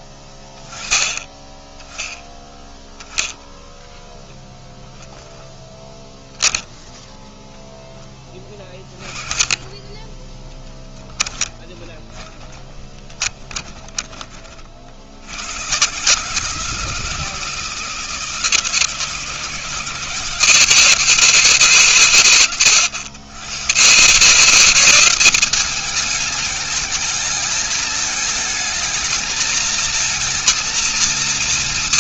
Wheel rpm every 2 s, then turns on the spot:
20, 10, 0, 10, 20, 20, 20, 40, 160, 160, 160, 120, 160, 220, 220, 230.
10-14